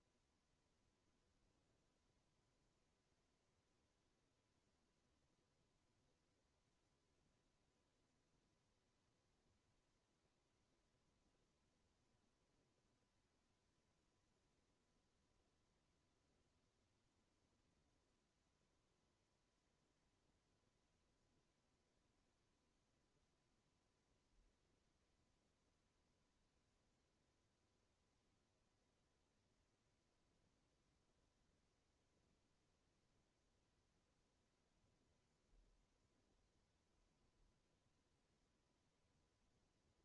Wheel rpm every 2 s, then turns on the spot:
0, 0, 0, 0, 0, 0, 0, 0, 0, 0, 0, 0, 0, 0, 0, 0, 0, 0, 0, 0.
none